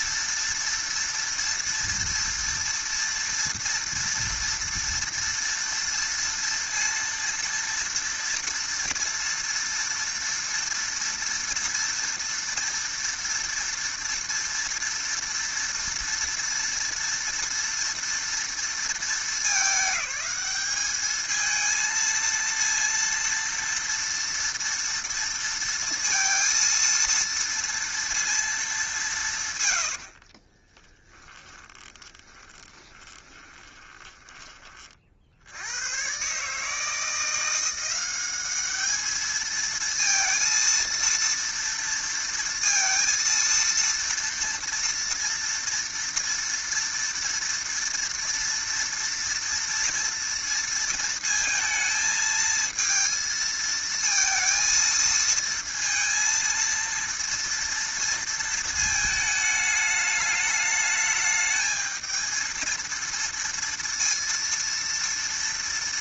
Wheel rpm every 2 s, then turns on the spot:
230, 230, 230, 230, 230, 230, 230, 230, 230, 220, 210, 230, 230, 230, 170, 10, 20, 40, 160, 210, 230, 230, 230, 230, 230, 230, 230, 230, 230, 220, 210, 230, 230.
30-34